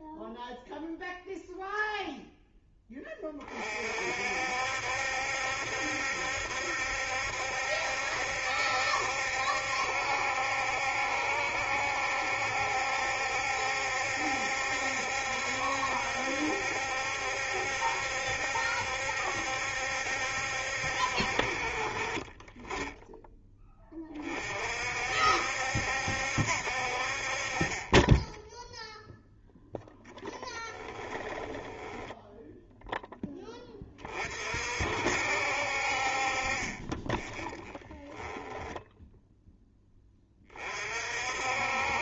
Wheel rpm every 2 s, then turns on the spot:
0, 10, 70, 70, 70, 70, 70, 70, 70, 70, 60, 10, 50, 50, 0, 10, 0, 50, 30, 10, 40.
30-32